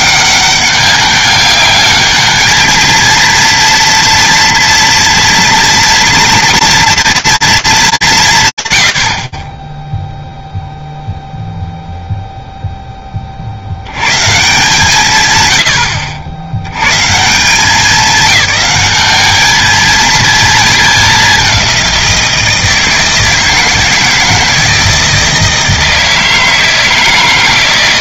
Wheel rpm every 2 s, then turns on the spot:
200, 230, 230, 230, 70, 0, 30, 160, 160, 210, 200, 160, 160, 160.
none